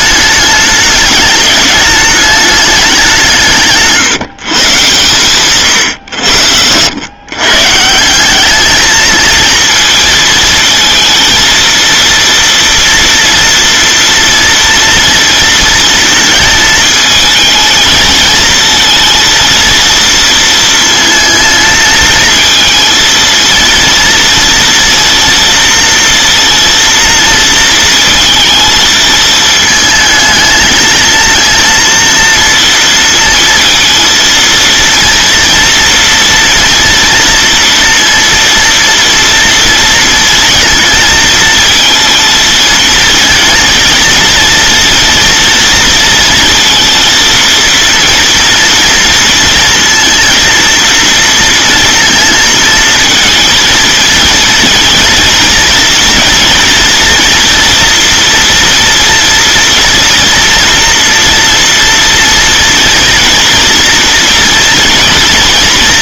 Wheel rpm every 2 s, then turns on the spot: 210, 210, 130, 80, 210, 230, 240, 230, 220, 230, 230, 230, 230, 230, 220, 220, 230, 230, 230, 230, 230, 220, 230, 230, 230, 230, 230, 230, 240, 230, 230, 230, 230.
none